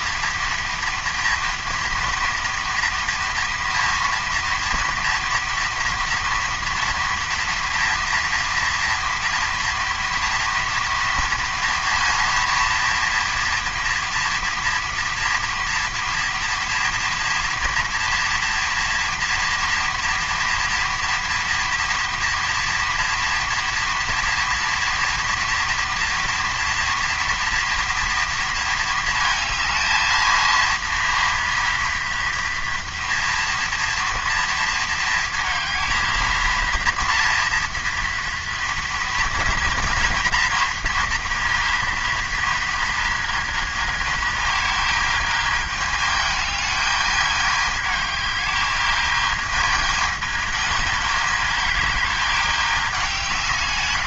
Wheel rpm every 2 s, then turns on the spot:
240, 230, 230, 240, 230, 230, 230, 230, 230, 230, 230, 230, 230, 230, 220, 230, 230, 220, 230, 230, 230, 220, 220, 210, 220, 210, 160.
none